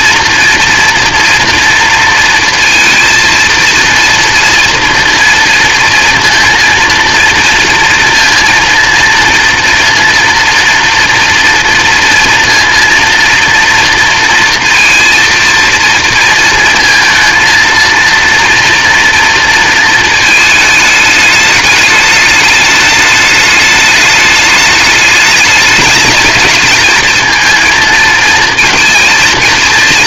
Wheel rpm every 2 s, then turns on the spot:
230, 230, 230, 230, 230, 230, 230, 230, 230, 240, 220, 210, 210, 220, 220.
none